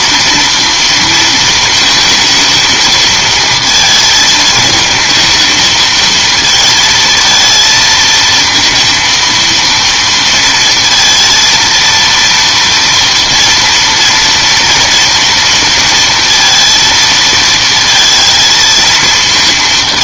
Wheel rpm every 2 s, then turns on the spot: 230, 220, 220, 220, 230, 230, 230, 230, 230, 220.
none